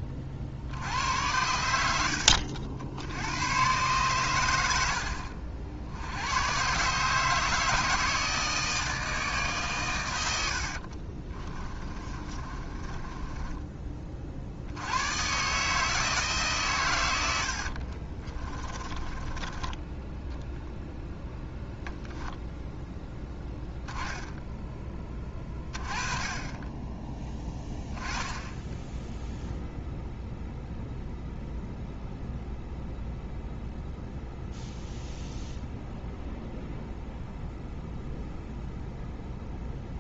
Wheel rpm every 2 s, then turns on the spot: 80, 80, 70, 140, 160, 50, 20, 90, 110, 20, 0, 10, 20, 20, 0, 0, 0, 0, 0, 0.
10-14 18-20